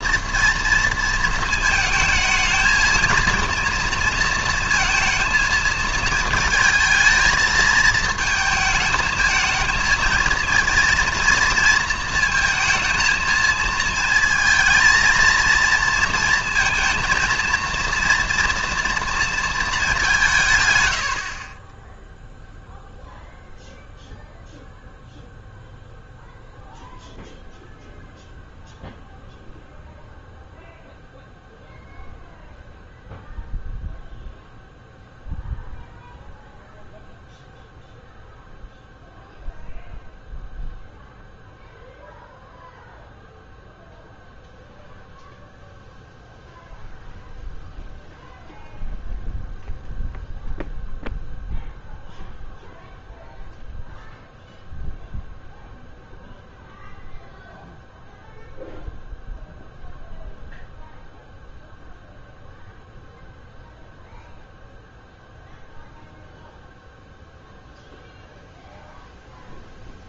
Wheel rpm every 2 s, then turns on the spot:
230, 220, 230, 220, 220, 220, 230, 220, 230, 230, 160, 0, 0, 0, 0, 0, 0, 0, 0, 0, 0, 0, 0, 0, 0, 0, 0, 0, 0, 0, 0, 0, 0, 0, 0.
none